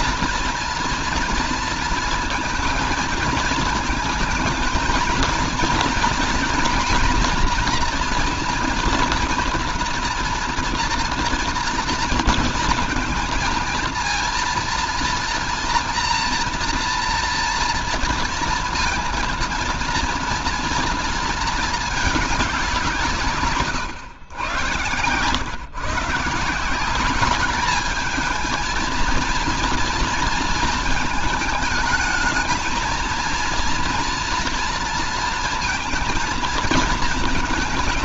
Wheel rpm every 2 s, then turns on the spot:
230, 230, 220, 230, 230, 230, 230, 230, 240, 230, 230, 200, 130, 160, 220, 230, 220, 230, 220.
none